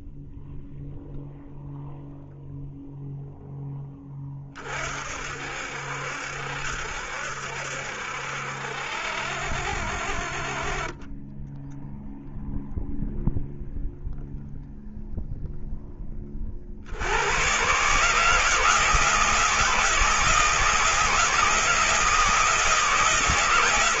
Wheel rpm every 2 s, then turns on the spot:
0, 0, 40, 70, 60, 40, 0, 0, 40, 160, 160, 160.
none